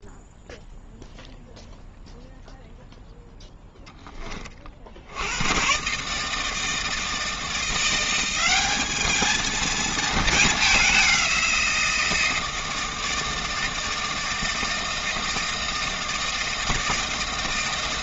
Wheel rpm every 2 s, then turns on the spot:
0, 0, 60, 160, 210, 210, 160, 160, 160.
none